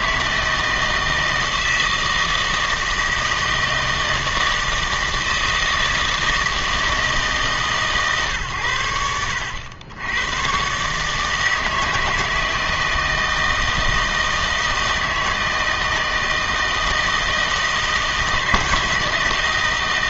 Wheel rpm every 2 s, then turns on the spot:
160, 160, 160, 160, 120, 120, 160, 160, 160, 160.
none